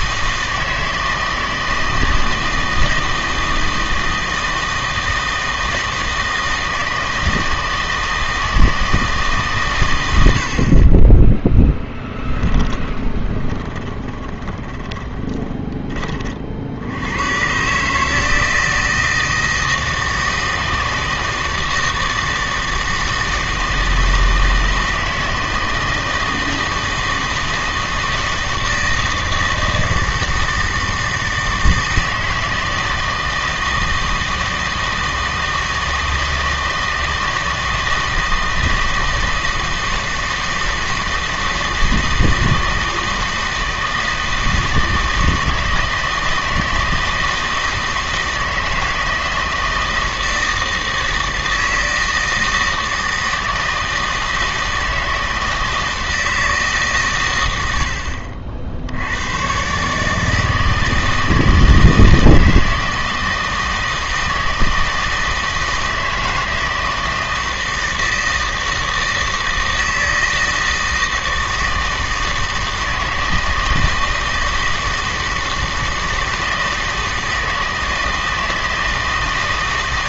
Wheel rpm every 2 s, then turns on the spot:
160, 160, 160, 160, 160, 40, 20, 30, 70, 160, 160, 160, 160, 160, 160, 160, 160, 160, 160, 160, 160, 160, 160, 160, 160, 160, 160, 160, 150, 70, 160, 160, 160, 160, 160, 160, 160, 160, 160, 160.
12-16